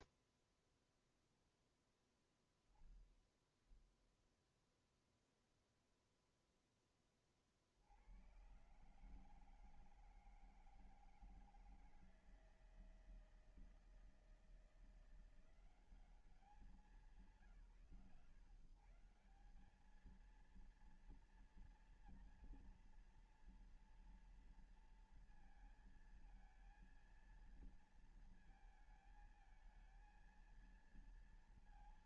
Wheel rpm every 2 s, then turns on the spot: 0, 0, 0, 0, 90, 160, 160, 160, 180, 140, 220, 230, 230, 230, 220, 230.
none